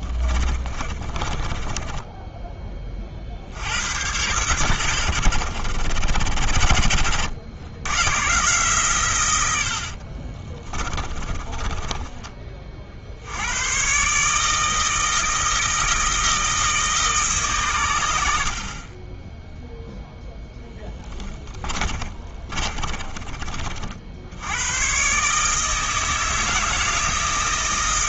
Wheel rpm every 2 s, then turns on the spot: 30, 20, 110, 70, 140, 30, 40, 160, 160, 40, 10, 40, 110, 160.
0-2 10-12 18-24